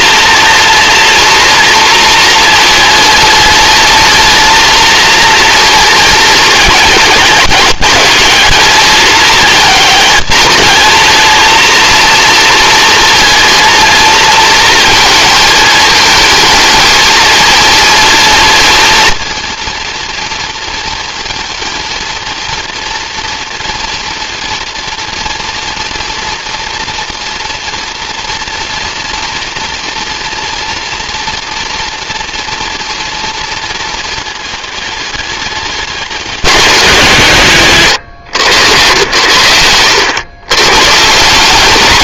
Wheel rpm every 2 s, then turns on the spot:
230, 220, 230, 220, 210, 220, 230, 220, 220, 230, 220, 230, 230, 230, 230, 240, 230, 220, 190, 120, 130.
none